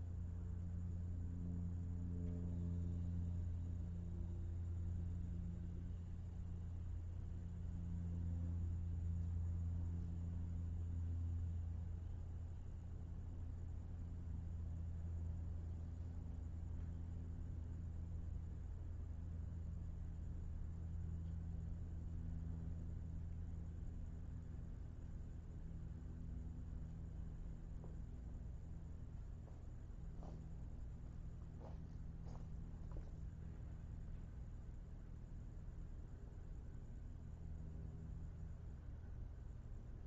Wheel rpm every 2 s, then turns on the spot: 0, 0, 0, 0, 0, 0, 0, 0, 0, 0, 0, 0, 0, 0, 0, 0, 0, 0, 0, 0.
none